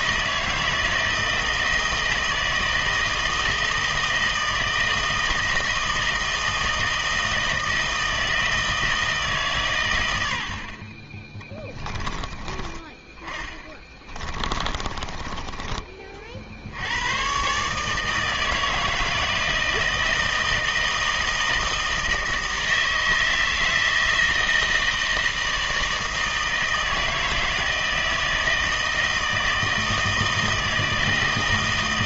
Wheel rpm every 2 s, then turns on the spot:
160, 160, 160, 160, 160, 60, 20, 30, 60, 160, 160, 160, 160, 160, 160, 160.
12-16